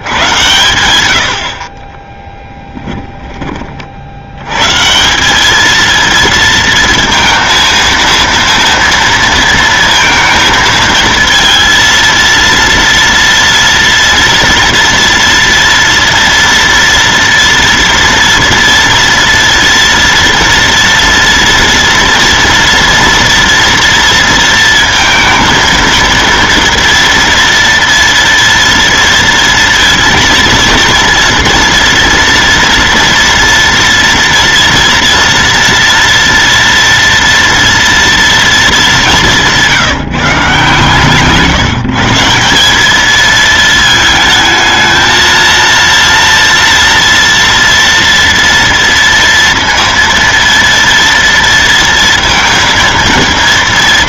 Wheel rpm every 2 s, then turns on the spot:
100, 10, 140, 230, 230, 230, 230, 230, 230, 230, 230, 230, 230, 230, 230, 230, 230, 230, 230, 210, 140, 200, 220, 230, 230, 230, 230.
none